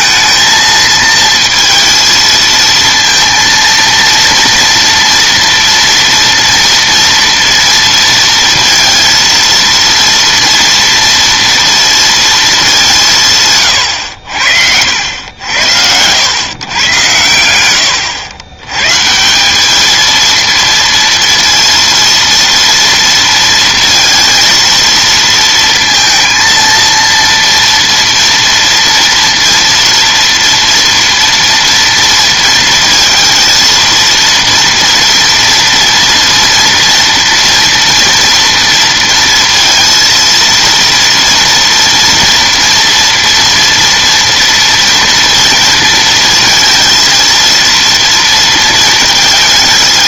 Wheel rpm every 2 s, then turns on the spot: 220, 230, 230, 230, 230, 230, 210, 70, 120, 110, 230, 230, 230, 230, 230, 240, 230, 240, 230, 230, 230, 240, 230, 230, 230.
none